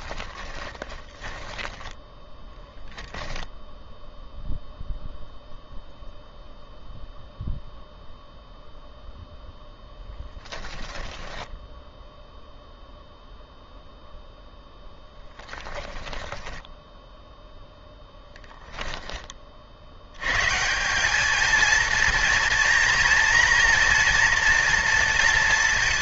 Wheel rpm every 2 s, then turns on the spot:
20, 10, 0, 0, 0, 10, 0, 0, 10, 10, 170, 230, 230.
0-2 10-12 16-18